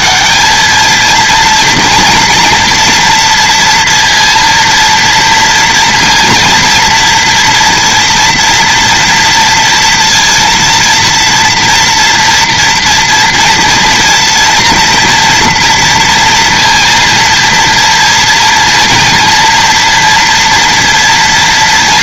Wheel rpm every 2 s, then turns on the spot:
220, 230, 230, 240, 230, 230, 230, 230, 230, 230, 230.
none